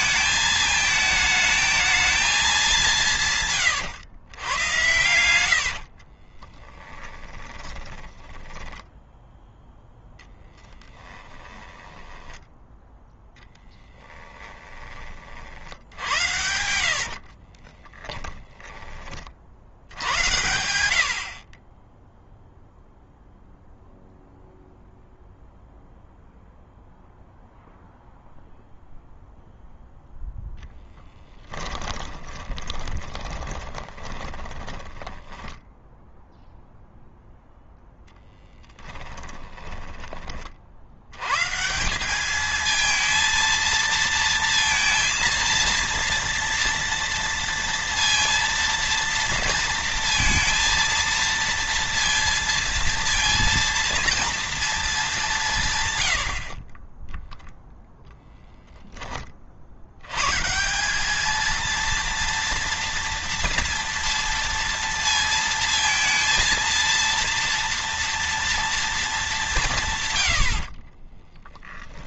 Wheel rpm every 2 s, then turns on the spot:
220, 210, 120, 30, 30, 10, 10, 20, 90, 10, 80, 0, 0, 0, 0, 0, 20, 20, 0, 10, 40, 220, 230, 230, 230, 230, 230, 230, 50, 0, 150, 240, 230, 230, 230, 70.
6-12 16-20 32-36 38-40 70-72